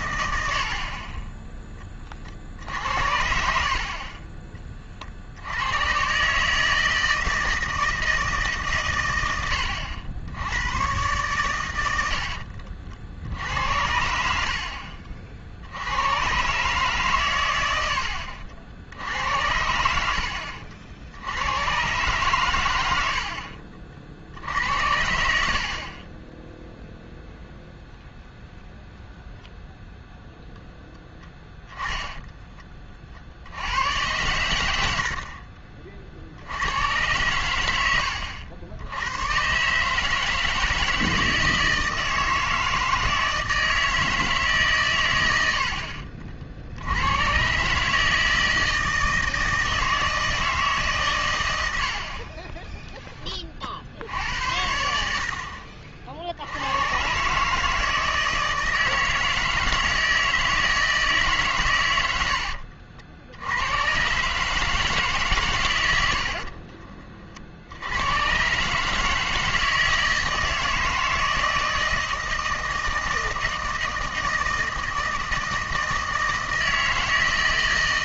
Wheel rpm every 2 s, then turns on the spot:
70, 60, 30, 160, 140, 100, 50, 60, 130, 70, 60, 110, 70, 0, 0, 0, 20, 100, 90, 80, 160, 160, 140, 60, 160, 150, 10, 80, 90, 160, 160, 70, 150, 50, 140, 160, 160, 160, 160.
0-2 12-16 66-68